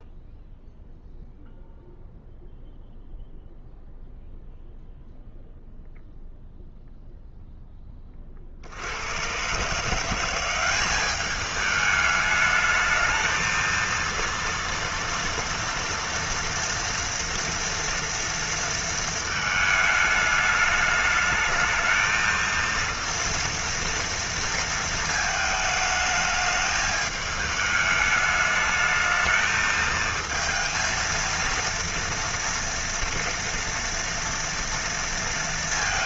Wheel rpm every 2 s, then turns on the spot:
0, 0, 0, 0, 40, 180, 210, 230, 240, 230, 210, 230, 230, 210, 210, 220, 230, 230.
none